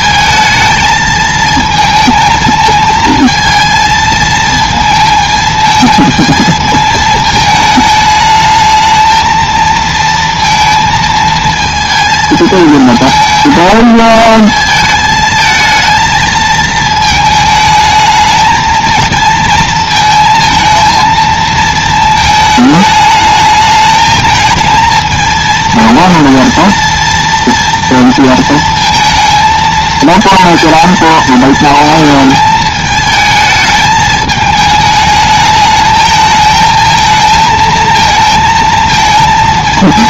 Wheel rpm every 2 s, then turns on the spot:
220, 220, 220, 220, 220, 230, 220, 220, 220, 230, 230, 220, 220, 230, 220, 230, 220, 220, 220, 230.
none